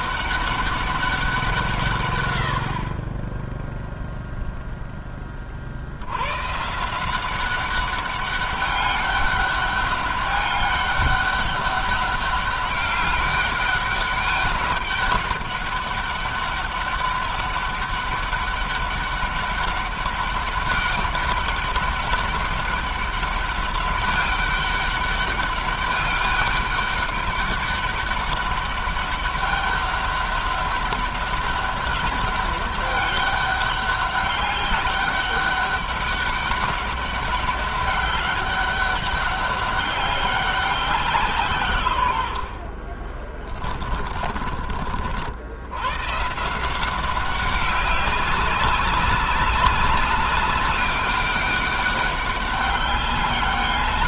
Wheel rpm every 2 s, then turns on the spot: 200, 140, 0, 70, 190, 200, 200, 200, 200, 200, 200, 200, 200, 200, 200, 200, 200, 200, 200, 200, 190, 100, 20, 120, 200, 200, 200.
44-46